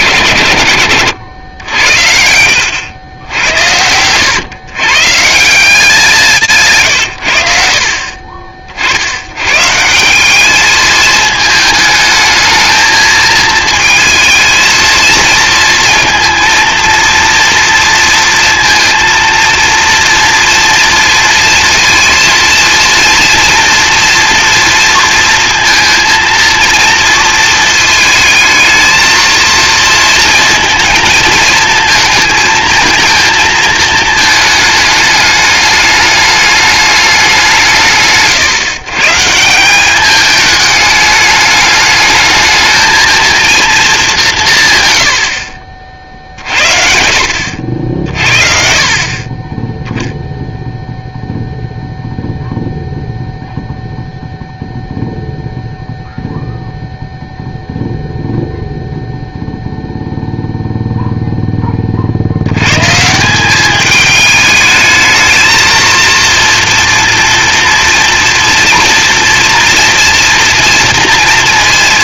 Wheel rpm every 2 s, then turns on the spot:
140, 90, 90, 170, 60, 170, 220, 220, 230, 230, 240, 230, 230, 230, 220, 230, 220, 220, 210, 150, 200, 210, 210, 40, 50, 0, 0, 0, 0, 0, 0, 80, 210, 230, 230, 230.
none